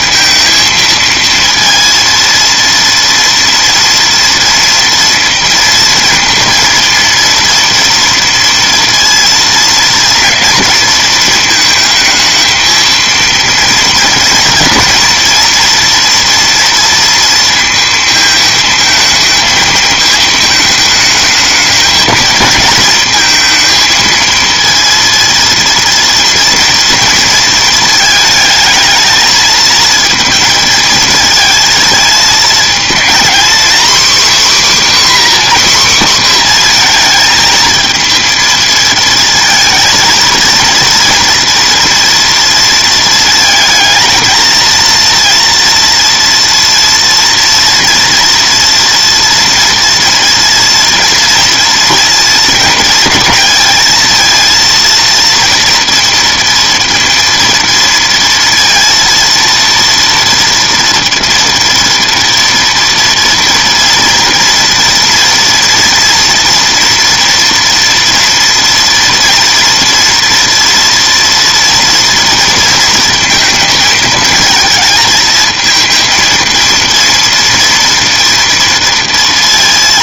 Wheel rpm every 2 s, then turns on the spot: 230, 230, 230, 230, 230, 230, 230, 230, 230, 220, 220, 220, 230, 230, 220, 230, 230, 280, 240, 230, 230, 230, 230, 230, 230, 230, 210, 230, 230, 230, 230, 230, 230, 230, 230, 230, 230, 220, 230, 230.
none